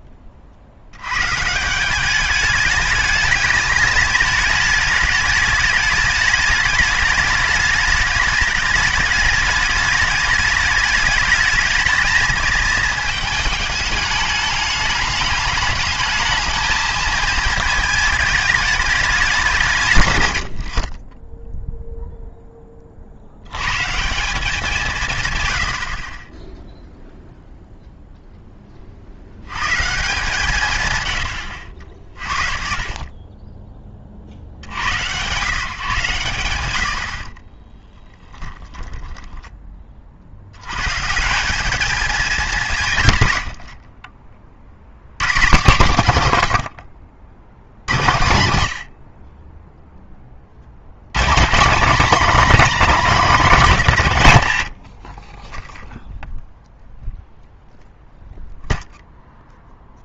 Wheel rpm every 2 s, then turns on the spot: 40, 210, 220, 210, 210, 210, 220, 210, 220, 210, 70, 10, 180, 0, 20, 150, 40, 70, 110, 10, 90, 200, 40, 100, 80, 70, 250, 90, 0, 0.
38-40